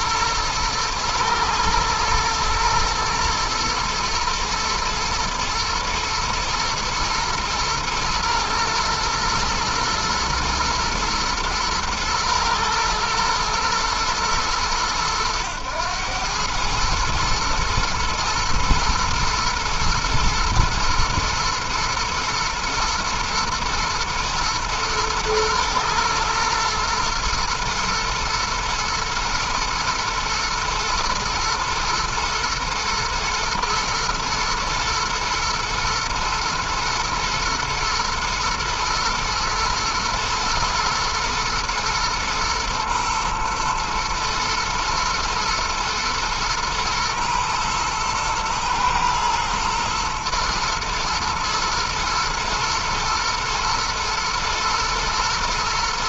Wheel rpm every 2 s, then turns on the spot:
110, 120, 110, 120, 120, 120, 110, 110, 110, 110, 110, 110, 110, 110, 110, 110, 110, 110, 120, 120, 120, 110, 120, 120, 120, 110, 110, 110.
none